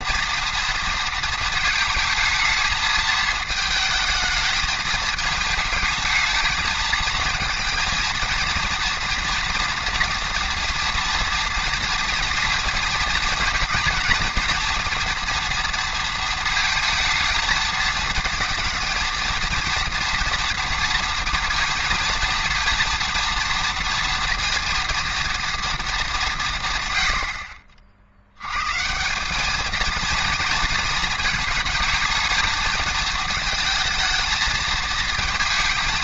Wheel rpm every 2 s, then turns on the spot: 230, 220, 210, 220, 230, 230, 230, 230, 230, 230, 230, 230, 230, 150, 120, 220, 220, 220.
none